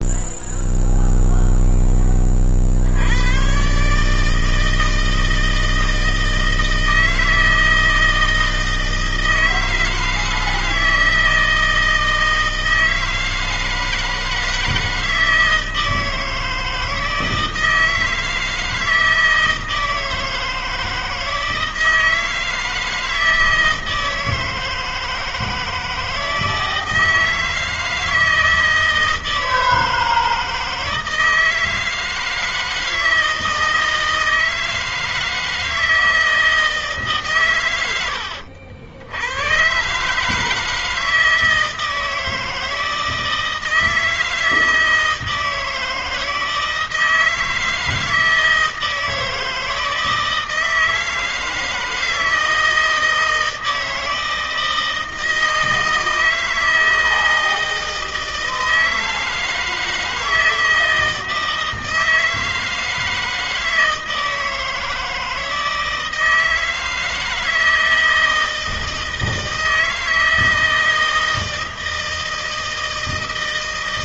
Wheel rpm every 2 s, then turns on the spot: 0, 50, 160, 160, 160, 160, 160, 160, 160, 160, 160, 160, 160, 160, 160, 160, 160, 160, 160, 70, 160, 160, 160, 160, 160, 160, 160, 160, 160, 160, 160, 160, 160, 160, 160, 160, 160.
none